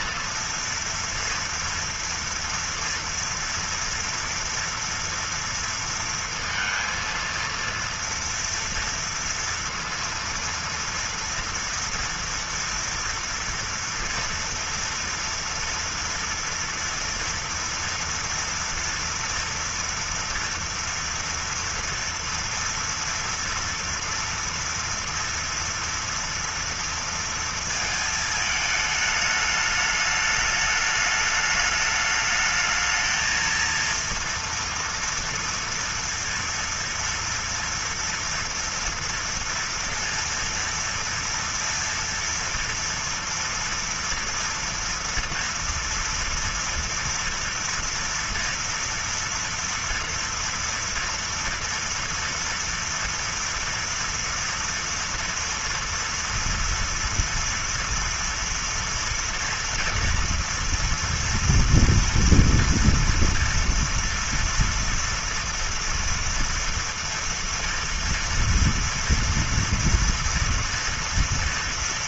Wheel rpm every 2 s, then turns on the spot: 230, 230, 230, 230, 230, 230, 230, 230, 230, 230, 230, 230, 230, 230, 220, 210, 220, 230, 230, 230, 230, 230, 230, 230, 240, 240, 230, 230, 240, 230, 230, 230, 230, 240, 240, 230.
none